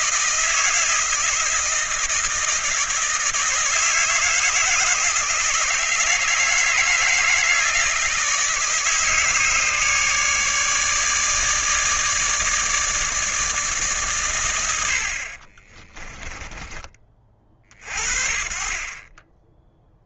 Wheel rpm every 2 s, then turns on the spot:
160, 160, 160, 160, 150, 150, 160, 80, 20, 30.
none